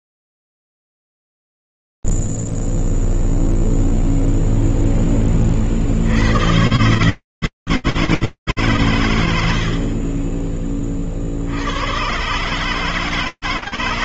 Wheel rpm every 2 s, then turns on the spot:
0, 0, 0, 0, 120, 60, 100.
10-12